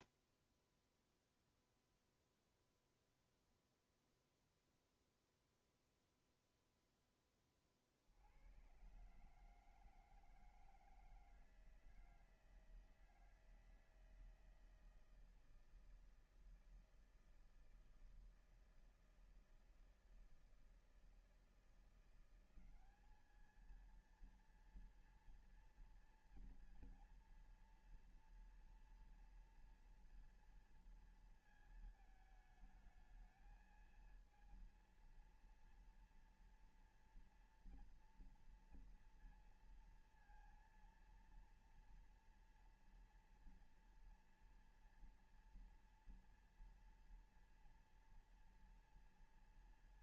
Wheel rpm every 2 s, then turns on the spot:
0, 0, 0, 0, 70, 160, 160, 160, 160, 160, 160, 170, 230, 230, 230, 230, 220, 220, 230, 230, 230, 230, 230, 230, 230.
none